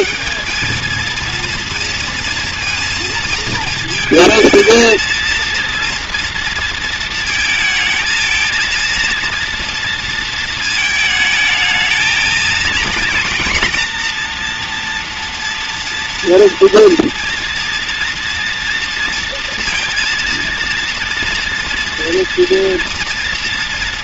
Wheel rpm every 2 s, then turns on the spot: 210, 230, 220, 230, 230, 220, 230, 230, 230, 230, 230, 230.
none